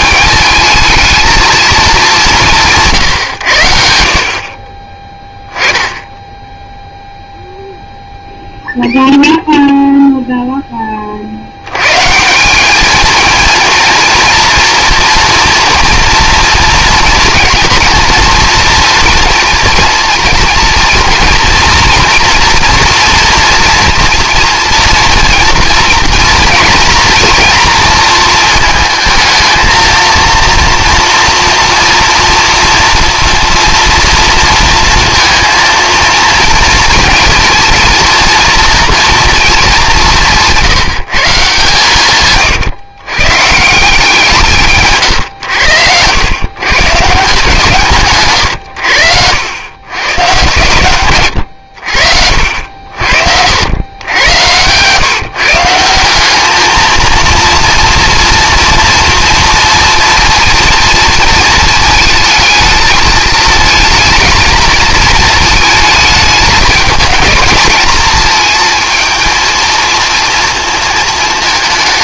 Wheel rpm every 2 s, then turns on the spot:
220, 180, 30, 0, 0, 10, 200, 240, 230, 230, 230, 240, 230, 230, 220, 230, 240, 230, 230, 230, 170, 130, 160, 120, 110, 130, 70, 120, 220, 230, 230, 220, 220, 210, 220, 230.
none